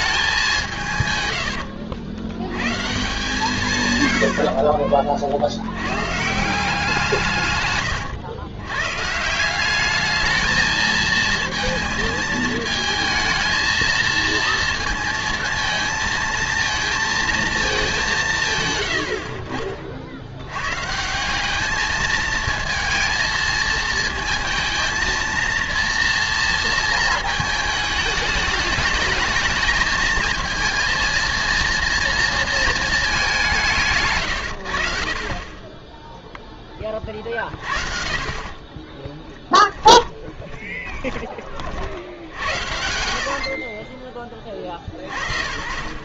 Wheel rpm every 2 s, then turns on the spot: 150, 140, 60, 170, 130, 220, 220, 230, 230, 120, 120, 230, 230, 230, 210, 230, 220, 80, 20, 20, 20, 80, 40.
38-44